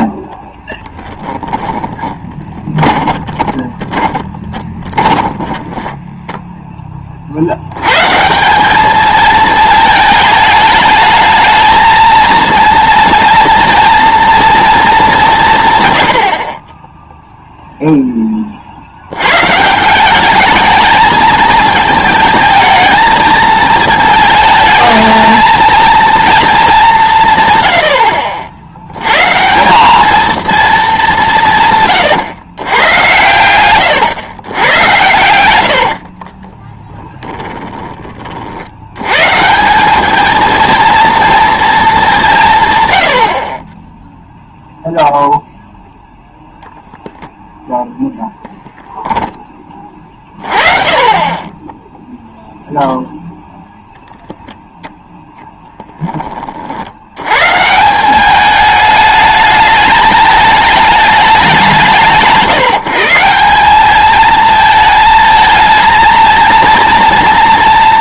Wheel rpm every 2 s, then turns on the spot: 10, 20, 20, 10, 200, 220, 230, 230, 30, 50, 210, 220, 220, 210, 80, 220, 120, 110, 30, 80, 230, 130, 0, 0, 10, 30, 0, 0, 50, 210, 210, 160, 220, 230.
2-6 36-38